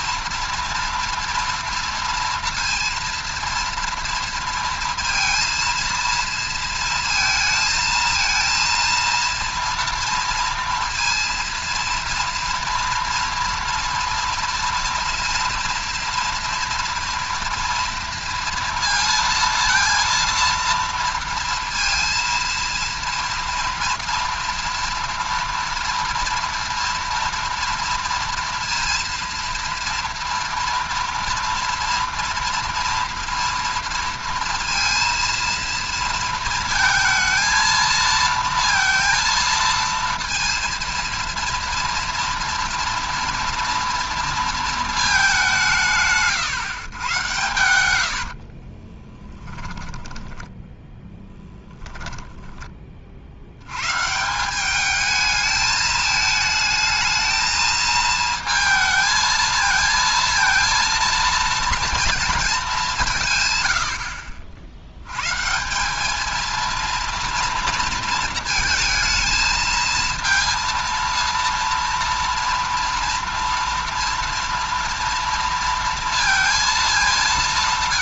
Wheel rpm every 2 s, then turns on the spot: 230, 230, 230, 230, 230, 230, 230, 230, 230, 230, 230, 230, 230, 230, 230, 230, 230, 230, 230, 230, 230, 230, 230, 130, 40, 10, 20, 190, 220, 220, 230, 210, 70, 230, 220, 230, 230, 230, 230.
48-52